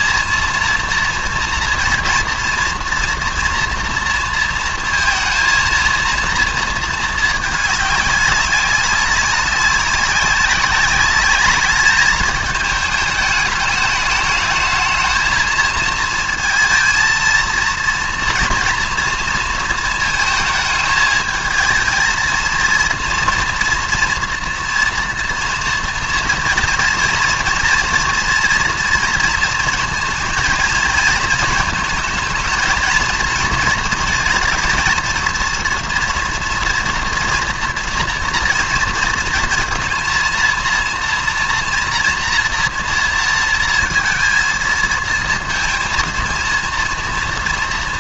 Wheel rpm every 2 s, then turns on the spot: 230, 230, 230, 220, 200, 200, 210, 220, 220, 240, 220, 230, 240, 240, 230, 230, 230, 220, 230, 230, 230, 230, 220, 230.
none